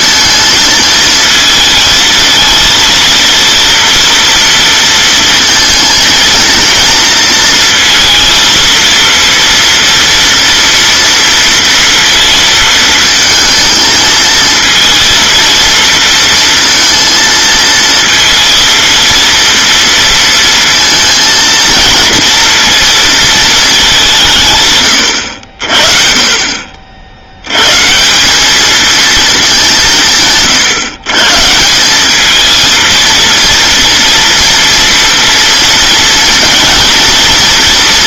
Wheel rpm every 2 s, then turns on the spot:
220, 230, 230, 230, 230, 230, 220, 230, 230, 230, 230, 230, 140, 50, 210, 140, 230, 230, 220.
none